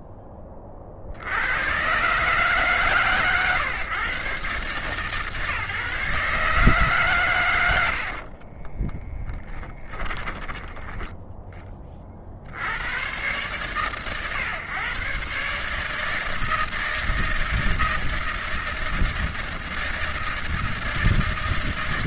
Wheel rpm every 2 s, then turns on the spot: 30, 130, 130, 140, 60, 10, 60, 130, 160, 160, 160.
8-10